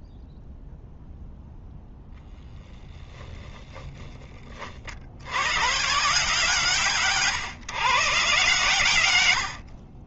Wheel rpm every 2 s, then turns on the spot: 0, 0, 30, 150, 130.
none